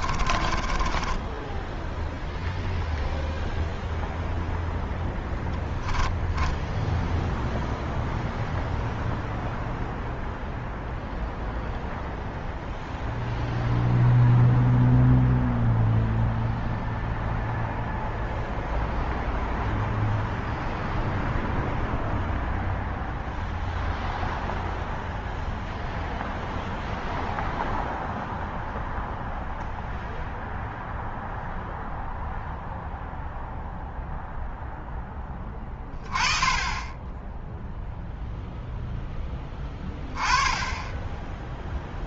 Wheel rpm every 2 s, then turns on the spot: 0, 0, 10, 0, 0, 0, 0, 0, 0, 0, 0, 0, 0, 0, 0, 0, 0, 20, 0, 10, 0.
4-6